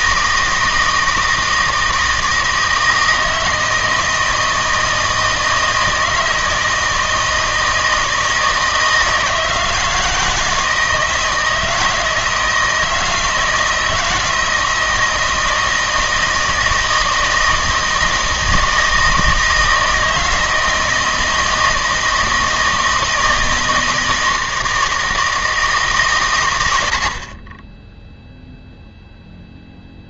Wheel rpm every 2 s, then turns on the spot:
160, 160, 160, 160, 160, 160, 160, 160, 160, 160, 160, 160, 160, 90, 0.
none